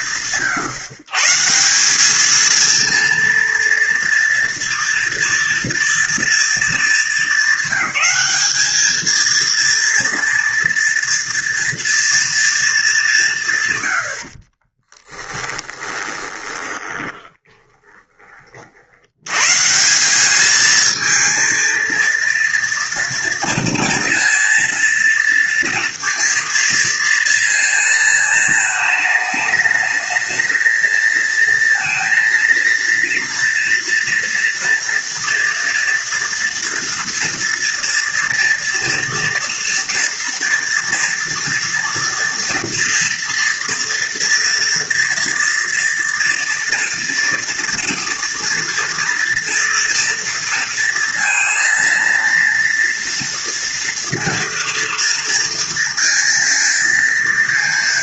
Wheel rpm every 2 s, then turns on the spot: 140, 230, 230, 210, 220, 230, 180, 10, 20, 90, 220, 230, 230, 230, 220, 230, 230, 230, 230, 230, 230, 230, 230, 240, 230, 230, 230, 230, 230.
14-18